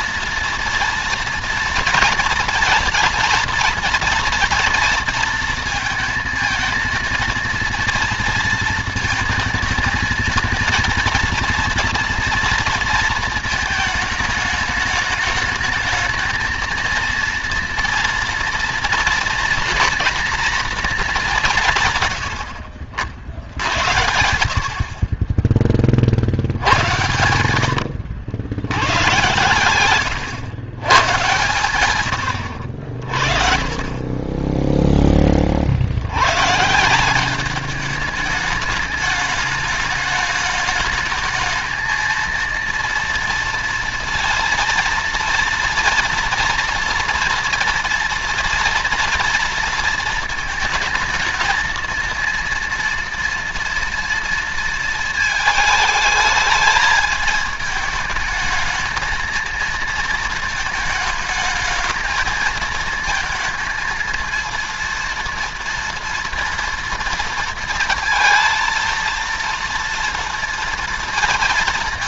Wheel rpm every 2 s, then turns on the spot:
240, 230, 230, 220, 230, 230, 230, 210, 220, 230, 230, 90, 70, 70, 90, 130, 80, 10, 140, 210, 210, 230, 230, 230, 230, 230, 240, 230, 220, 220, 220, 220, 230, 230, 230, 230.
34-36